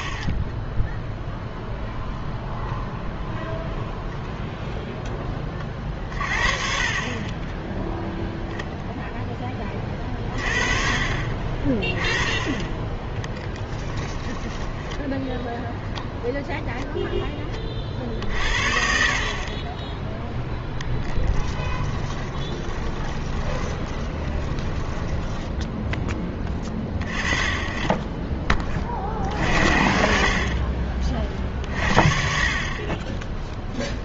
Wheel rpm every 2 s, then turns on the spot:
0, 0, 0, 40, 0, 40, 20, 10, 0, 60, 10, 30, 20, 20, 20, 40, 40.
14-16 22-26